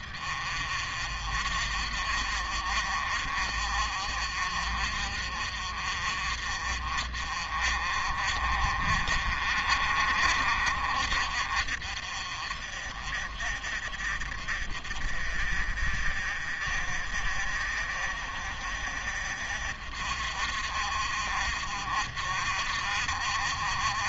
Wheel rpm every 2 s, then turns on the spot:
50, 50, 50, 50, 40, 50, 50, 50, 50, 50, 50, 50.
none